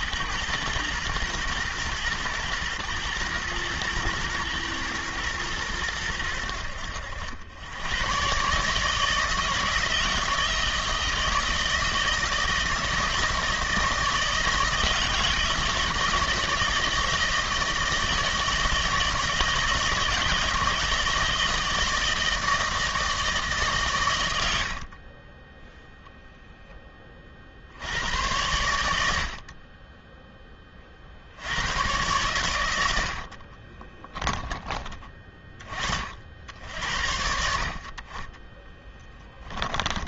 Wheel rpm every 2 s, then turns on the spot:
120, 110, 110, 80, 150, 170, 160, 160, 170, 160, 160, 160, 60, 10, 90, 20, 100, 20, 80, 10.
38-40